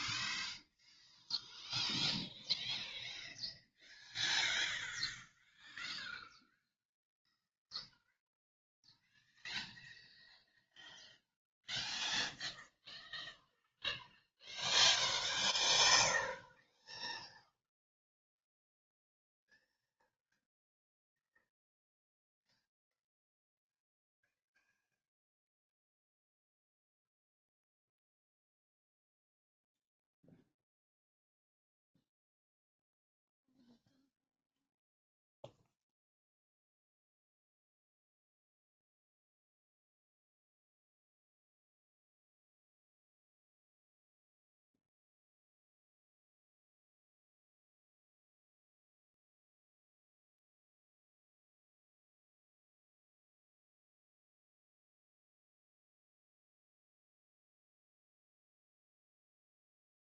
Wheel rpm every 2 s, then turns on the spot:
0, 0, 0, 0, 0, 0, 0, 0, 0, 0, 0, 0, 0, 0, 0, 0, 0, 0, 0, 0, 0, 0, 0, 0, 0, 0, 0, 0, 0, 0.
none